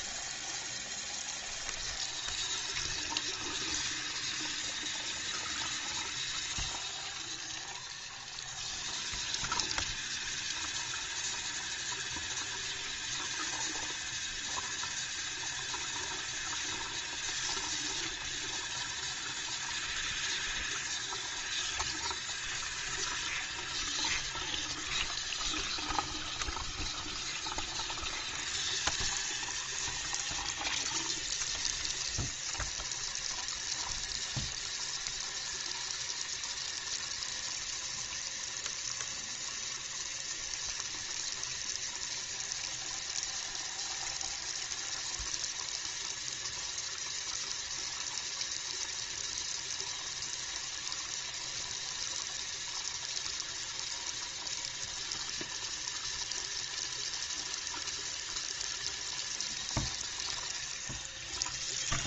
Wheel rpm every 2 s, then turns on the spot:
0, 0, 0, 0, 0, 0, 0, 0, 0, 0, 0, 0, 0, 0, 0, 0, 0, 0, 0, 0, 0, 0, 0, 0, 0, 0, 0, 0, 0, 0, 0.
none